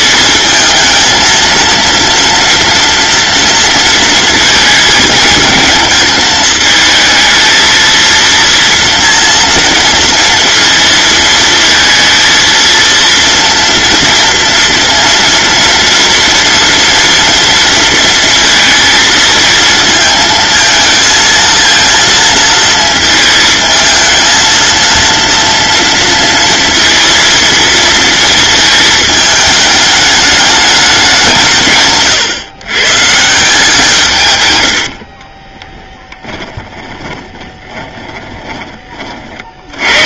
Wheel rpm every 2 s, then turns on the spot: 220, 230, 220, 220, 230, 230, 230, 230, 230, 230, 220, 220, 230, 230, 220, 200, 130, 80, 30, 30.
36-38